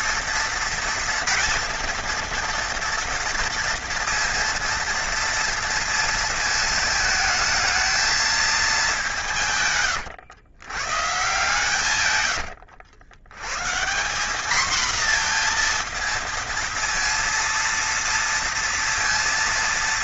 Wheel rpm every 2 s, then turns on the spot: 230, 230, 230, 230, 210, 120, 100, 220, 230, 230.
12-14